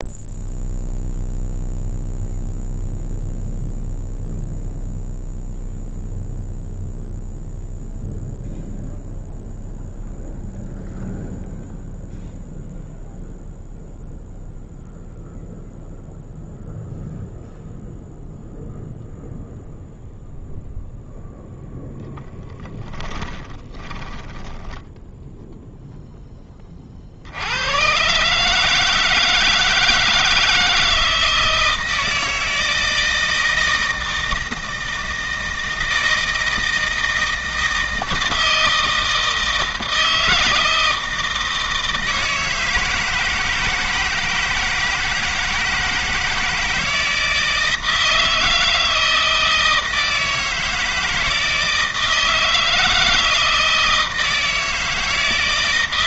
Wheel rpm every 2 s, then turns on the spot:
0, 0, 0, 0, 0, 0, 0, 0, 0, 0, 0, 10, 10, 20, 150, 160, 160, 160, 160, 160, 160, 160, 160, 160, 160, 160, 160, 160.
22-26